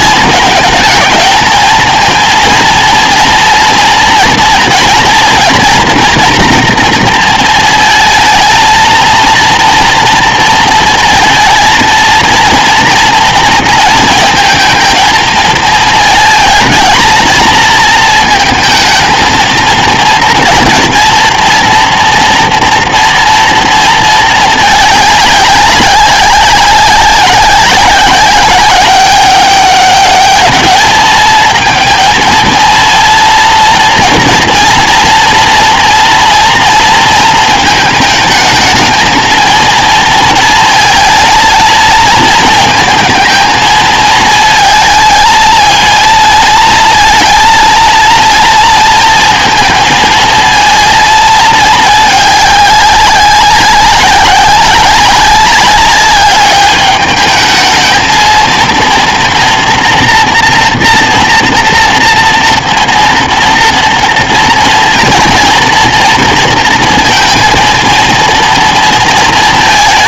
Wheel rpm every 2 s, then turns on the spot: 220, 230, 230, 230, 220, 230, 230, 230, 220, 220, 230, 230, 220, 190, 200, 220, 230, 230, 230, 220, 230, 220, 220, 220, 230, 230, 200, 190, 200, 230, 230, 230, 230, 230, 230.
none